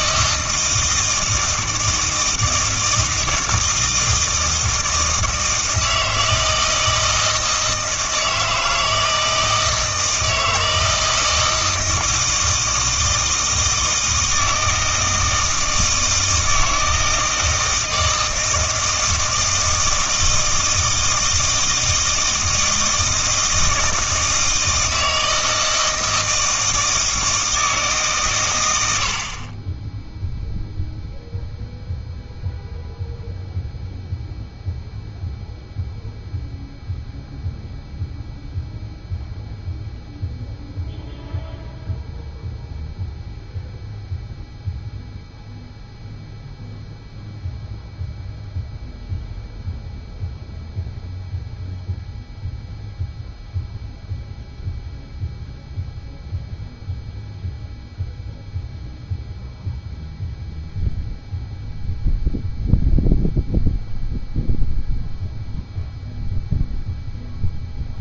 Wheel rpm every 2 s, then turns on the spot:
160, 160, 160, 160, 160, 160, 160, 160, 160, 160, 160, 160, 160, 160, 90, 0, 0, 0, 0, 0, 0, 0, 0, 0, 0, 0, 0, 0, 0, 0, 0, 0, 0, 0.
none